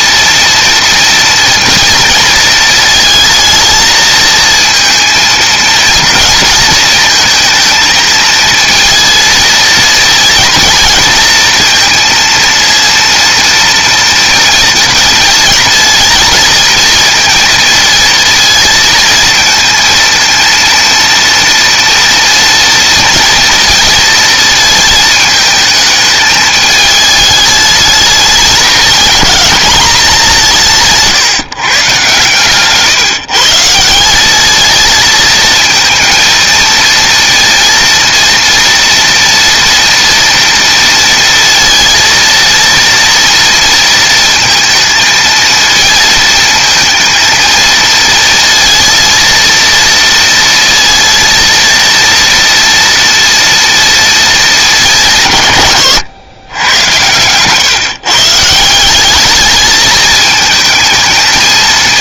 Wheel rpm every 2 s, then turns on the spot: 230, 230, 230, 230, 220, 230, 230, 230, 220, 220, 230, 230, 230, 220, 210, 190, 130, 200, 230, 230, 230, 230, 230, 220, 230, 230, 230, 210, 100, 140, 220.
none